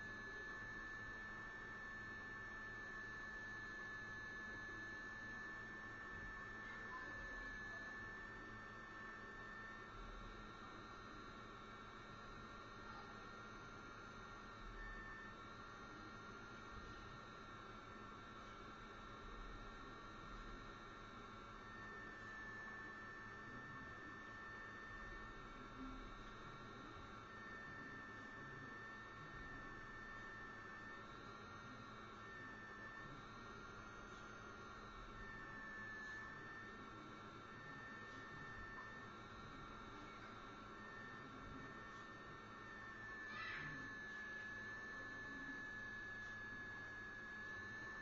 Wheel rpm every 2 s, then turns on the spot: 0, 0, 0, 0, 0, 0, 0, 0, 0, 0, 0, 0, 0, 0, 0, 0, 0, 0, 0, 0, 0, 0, 0, 0.
none